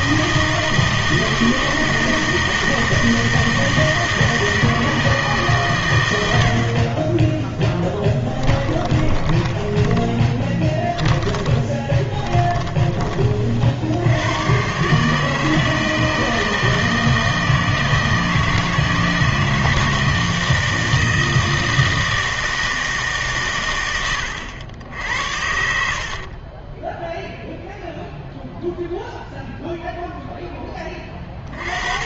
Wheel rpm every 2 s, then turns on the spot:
160, 160, 160, 50, 20, 20, 20, 130, 160, 160, 160, 160, 90, 20, 0, 20.
8-12 26-28